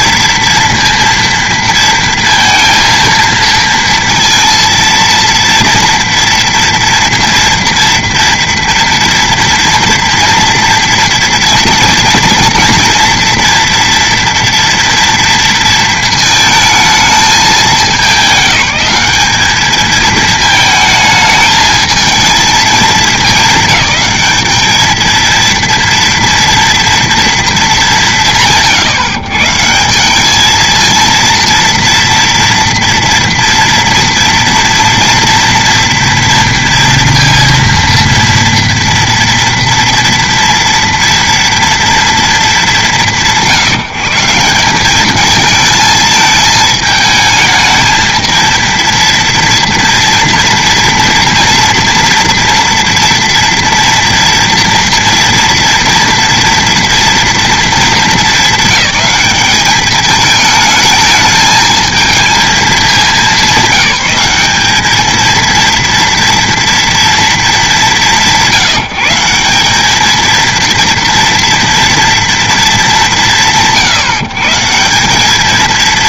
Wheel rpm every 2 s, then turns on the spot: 230, 230, 230, 230, 230, 230, 230, 230, 220, 200, 220, 220, 220, 230, 130, 230, 230, 230, 230, 230, 230, 170, 220, 220, 230, 230, 240, 230, 230, 210, 220, 200, 220, 230, 180, 230, 170, 170.
none